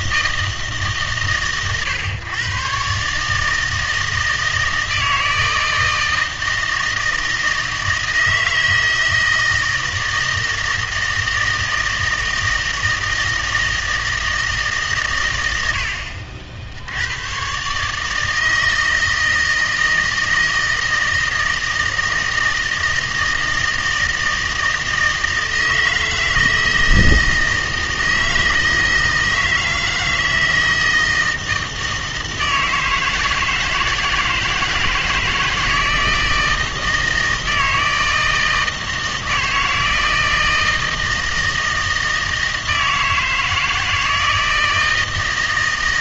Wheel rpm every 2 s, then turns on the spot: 160, 130, 160, 160, 160, 160, 160, 150, 80, 160, 160, 160, 160, 160, 160, 160, 160, 160, 160, 160, 160, 160, 160.
none